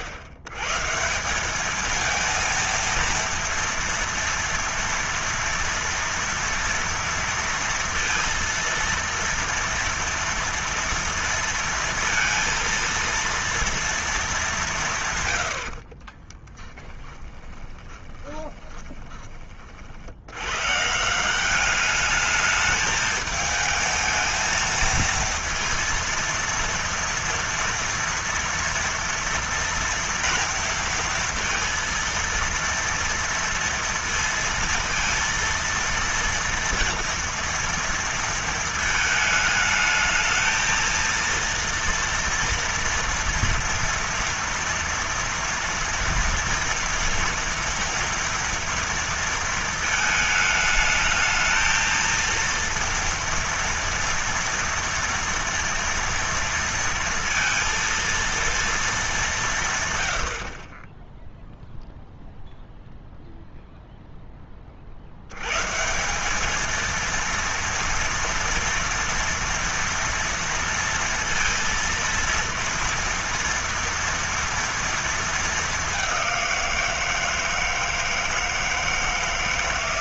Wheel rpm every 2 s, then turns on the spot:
120, 230, 230, 230, 230, 230, 230, 190, 10, 20, 140, 210, 220, 230, 230, 230, 230, 230, 230, 220, 220, 230, 230, 230, 230, 220, 230, 230, 230, 230, 50, 0, 30, 220, 230, 230, 230, 230, 180, 160.
16-20